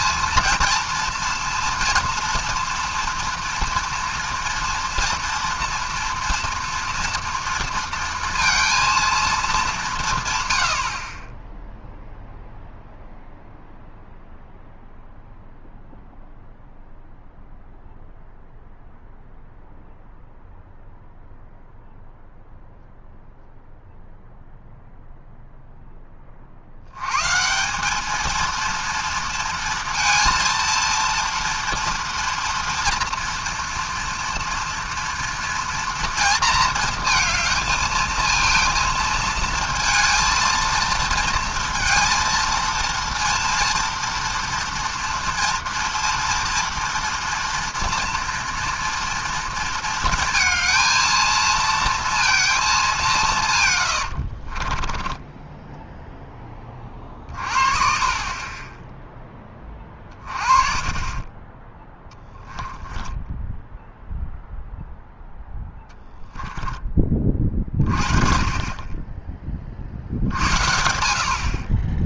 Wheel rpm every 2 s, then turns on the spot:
230, 230, 230, 230, 230, 100, 0, 0, 0, 0, 0, 0, 0, 50, 220, 230, 230, 230, 230, 220, 230, 230, 230, 230, 230, 230, 220, 30, 20, 20, 30, 10, 0, 10, 30, 60.
54-56